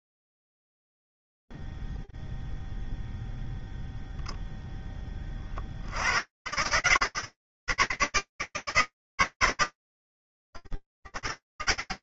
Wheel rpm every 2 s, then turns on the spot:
0, 0, 0, 70, 160, 100.
none